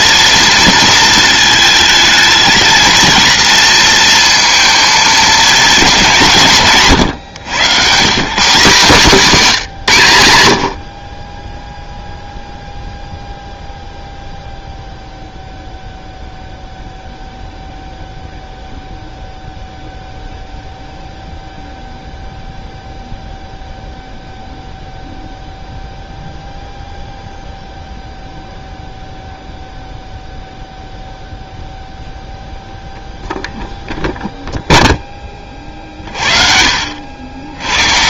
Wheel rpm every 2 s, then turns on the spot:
230, 230, 230, 170, 170, 80, 0, 0, 0, 0, 0, 0, 0, 0, 0, 0, 0, 0, 60.
none